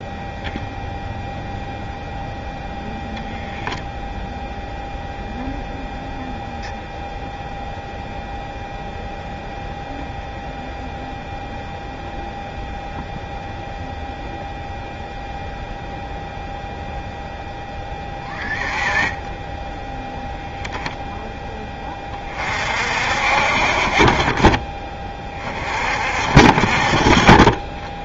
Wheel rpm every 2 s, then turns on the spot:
0, 0, 0, 0, 0, 0, 0, 0, 0, 10, 0, 50, 20, 30.
none